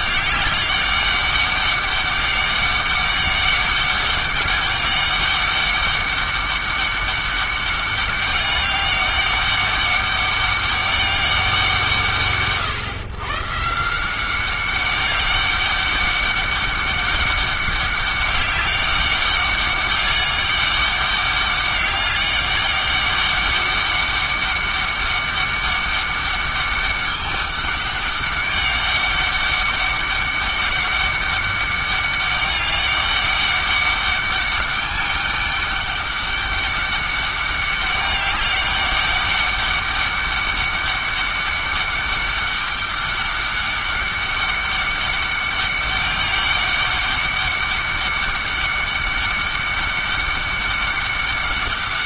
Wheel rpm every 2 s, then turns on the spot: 200, 200, 200, 200, 200, 200, 120, 190, 200, 200, 200, 200, 200, 200, 200, 200, 200, 200, 200, 200, 200, 200, 200, 200, 200, 200.
none